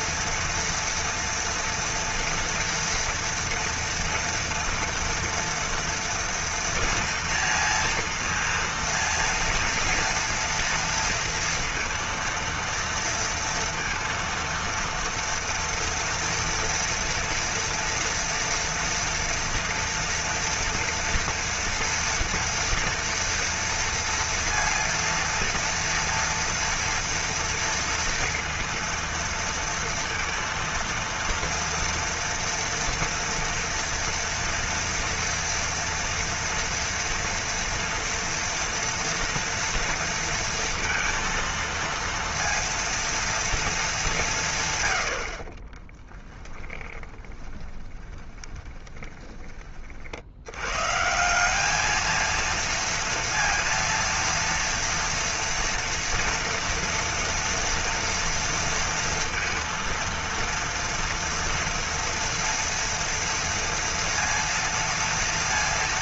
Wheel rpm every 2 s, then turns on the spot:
240, 230, 230, 230, 230, 230, 230, 230, 230, 230, 230, 230, 230, 230, 230, 230, 230, 230, 230, 230, 230, 230, 180, 10, 20, 80, 220, 230, 240, 230, 230, 230, 230.
46-50